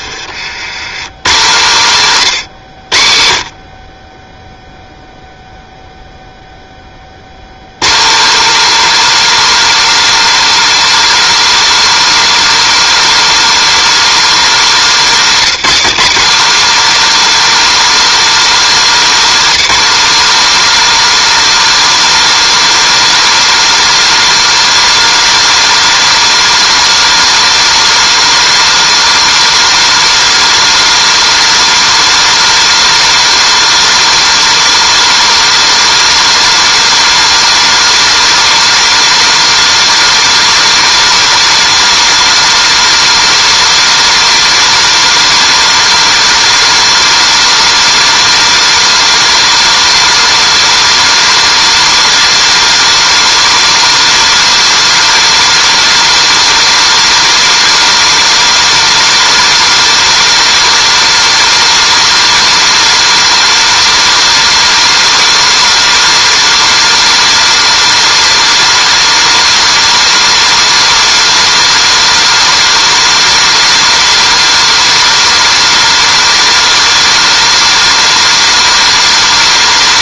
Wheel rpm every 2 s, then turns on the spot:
110, 100, 0, 10, 280, 310, 310, 260, 260, 290, 300, 310, 310, 310, 310, 310, 310, 310, 310, 310, 310, 310, 310, 310, 310, 310, 310, 310, 310, 310, 310, 310, 310, 310, 310, 310, 310, 310, 310, 310.
none